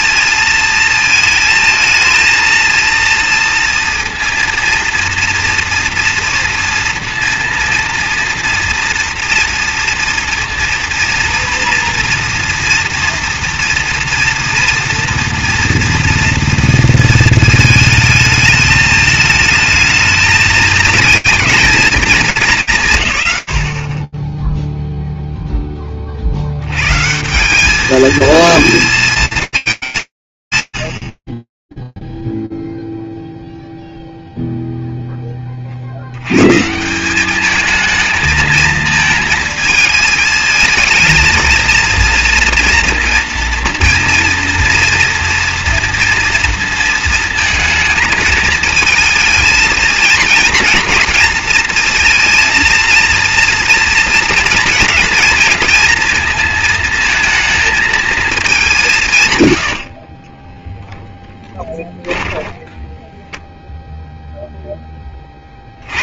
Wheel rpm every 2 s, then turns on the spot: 230, 230, 230, 240, 230, 230, 230, 230, 230, 220, 220, 180, 0, 120, 230, 150, 0, 0, 130, 220, 220, 230, 230, 230, 220, 230, 230, 230, 230, 200, 10, 10, 60.
60-64